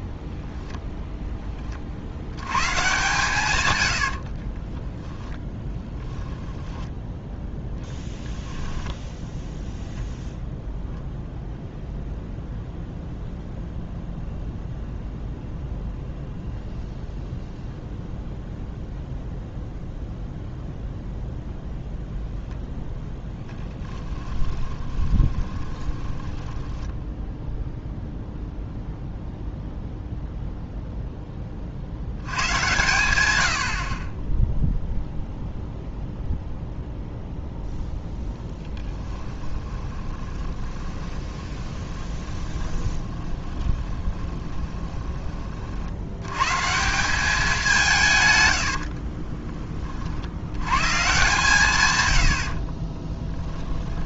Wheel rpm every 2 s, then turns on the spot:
0, 130, 20, 10, 0, 0, 0, 0, 0, 0, 0, 0, 20, 10, 0, 0, 110, 0, 0, 10, 20, 20, 20, 170, 70, 130, 30.
4-8 24-28 38-44 48-50 52-54